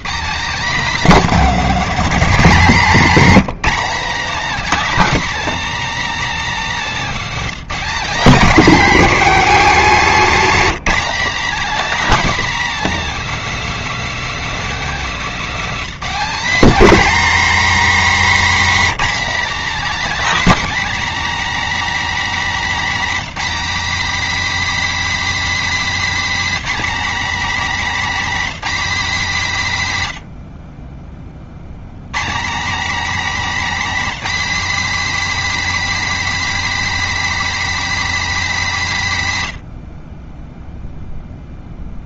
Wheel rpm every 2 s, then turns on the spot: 250, 220, 280, 230, 250, 250, 260, 220, 260, 260, 280, 260, 290, 270, 240, 20, 240, 280, 290, 210, 0.
none